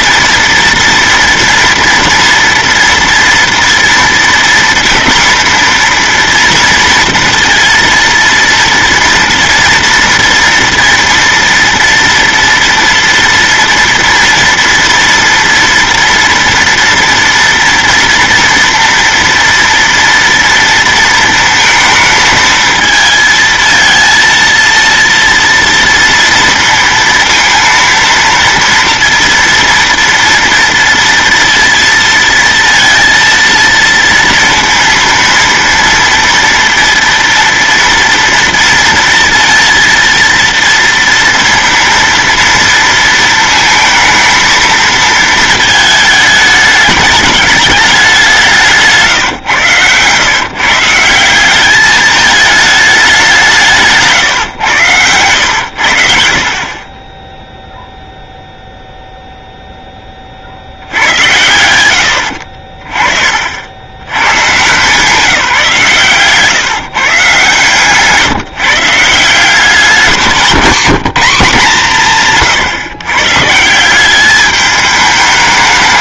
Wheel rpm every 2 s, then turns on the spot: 230, 230, 230, 230, 230, 230, 230, 230, 230, 230, 230, 220, 230, 230, 230, 230, 230, 230, 230, 230, 230, 230, 220, 210, 170, 140, 220, 120, 40, 0, 60, 50, 130, 150, 150, 180, 140, 210.
70-72